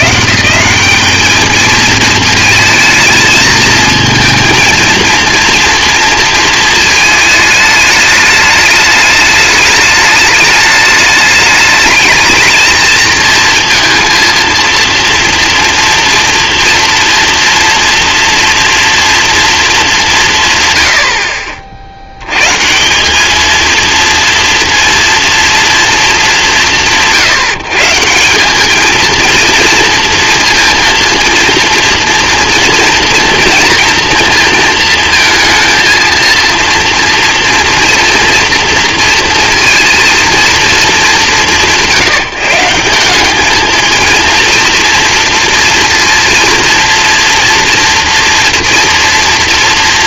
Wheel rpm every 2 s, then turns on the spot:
160, 230, 220, 220, 210, 210, 220, 230, 240, 230, 120, 140, 230, 180, 210, 230, 240, 230, 230, 230, 220, 170, 230, 230, 230.
none